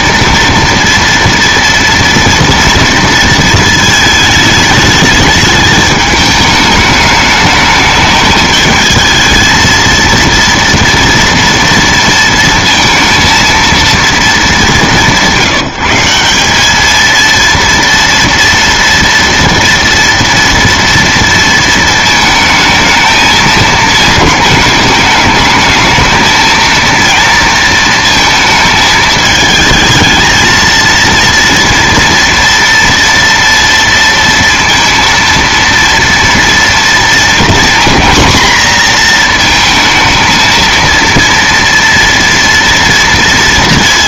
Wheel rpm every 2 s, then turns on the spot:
230, 230, 220, 210, 210, 230, 230, 190, 200, 240, 230, 220, 210, 230, 220, 230, 230, 230, 230, 240, 220, 230.
none